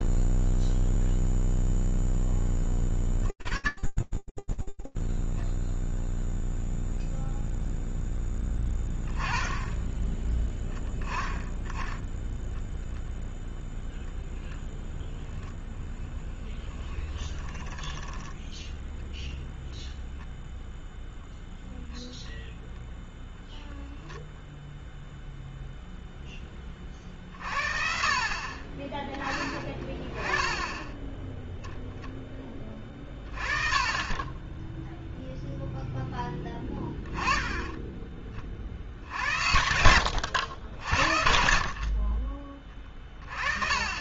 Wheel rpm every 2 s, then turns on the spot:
0, 20, 10, 0, 0, 10, 0, 0, 20, 10, 0, 0, 0, 40, 20, 0, 30, 0, 10, 80, 70, 20.
16-20